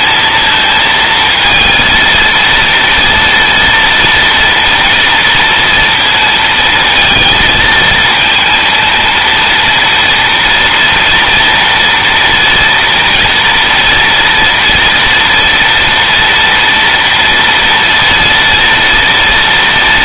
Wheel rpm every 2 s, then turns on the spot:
230, 230, 230, 230, 230, 230, 240, 230, 230, 230.
none